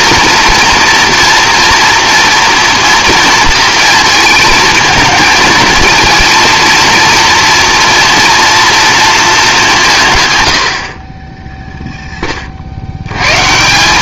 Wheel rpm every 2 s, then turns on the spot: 240, 240, 220, 230, 230, 80, 60.
none